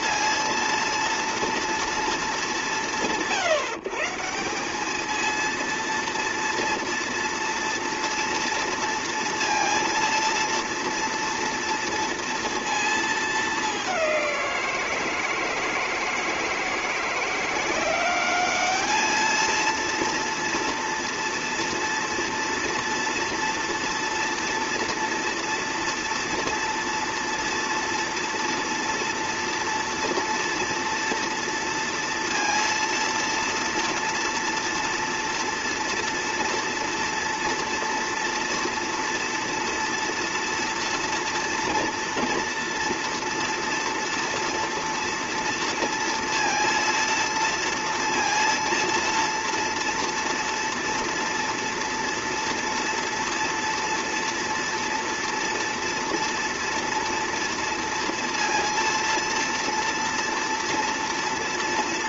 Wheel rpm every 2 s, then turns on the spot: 230, 140, 200, 230, 230, 230, 230, 170, 160, 210, 230, 230, 230, 230, 230, 230, 230, 230, 240, 230, 230, 230, 230, 230, 230, 230, 230, 230, 230, 230, 230.
none